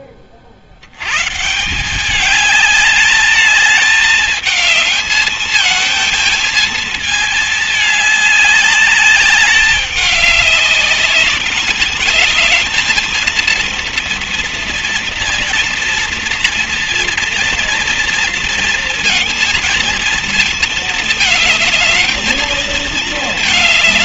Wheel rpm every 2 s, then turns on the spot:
70, 210, 220, 220, 200, 200, 220, 230, 230, 230, 220, 220.
none